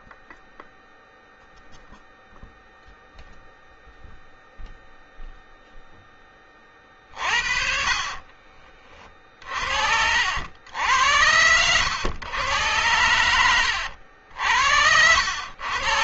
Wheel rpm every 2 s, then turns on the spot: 0, 0, 0, 30, 30, 80, 100, 70.
none